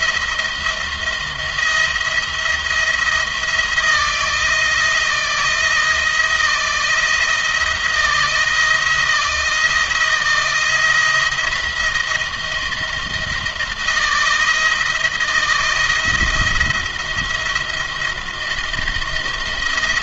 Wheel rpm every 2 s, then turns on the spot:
170, 170, 170, 170, 170, 170, 170, 160, 170, 170.
none